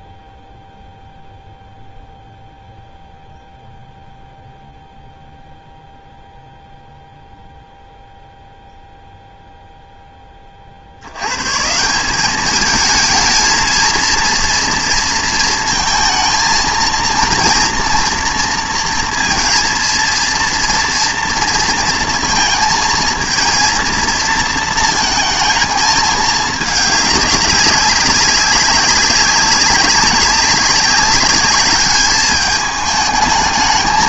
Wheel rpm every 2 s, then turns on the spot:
0, 0, 0, 0, 0, 50, 210, 230, 220, 230, 230, 220, 230, 220, 190, 200, 210.
none